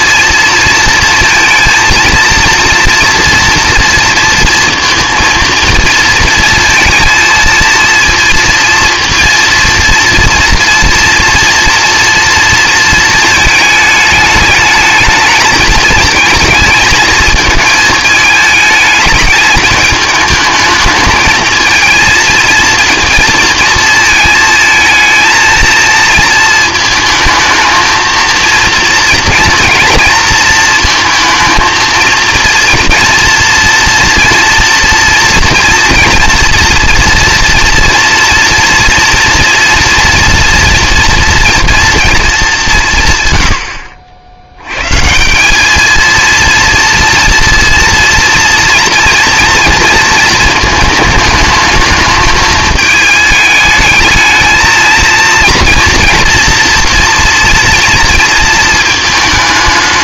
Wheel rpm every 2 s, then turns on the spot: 230, 230, 230, 230, 230, 230, 230, 220, 220, 220, 220, 230, 220, 220, 230, 230, 230, 230, 230, 230, 230, 190, 120, 230, 230, 220, 220, 220, 240, 230.
none